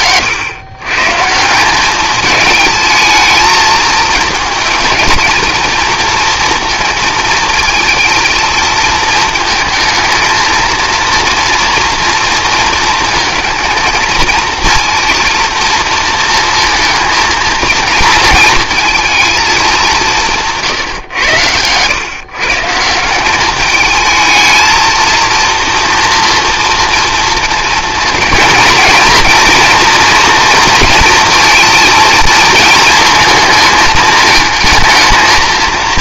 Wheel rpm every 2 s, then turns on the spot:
120, 220, 230, 230, 220, 230, 230, 230, 230, 220, 130, 170, 220, 230, 220, 230, 220, 220.
none